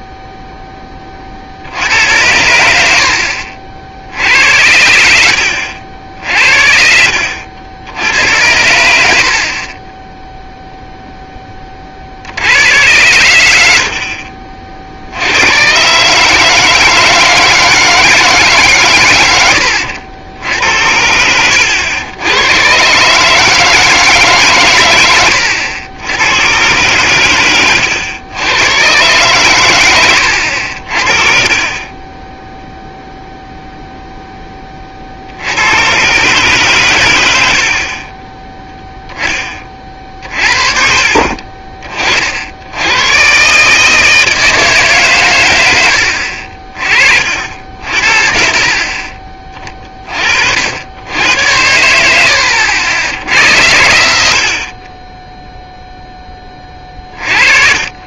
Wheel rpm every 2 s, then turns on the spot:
10, 90, 80, 60, 80, 0, 80, 50, 160, 140, 80, 110, 130, 120, 110, 60, 0, 20, 140, 10, 40, 80, 150, 50, 50, 70, 80, 40, 20.
2-4